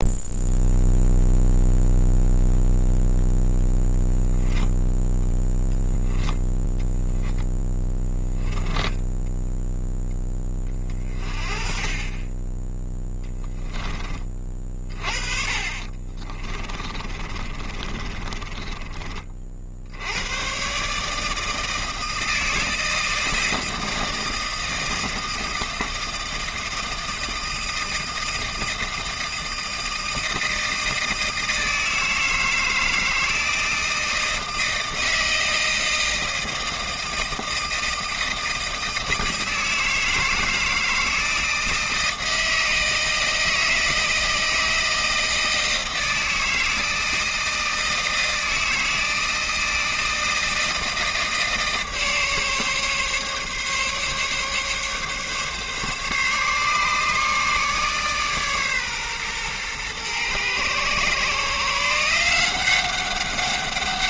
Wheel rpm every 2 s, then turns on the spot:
0, 0, 10, 10, 10, 20, 10, 40, 20, 20, 130, 160, 160, 160, 160, 160, 160, 160, 160, 160, 160, 160, 160, 160, 160, 160, 150, 140, 150, 140, 120, 180.
8-10 14-20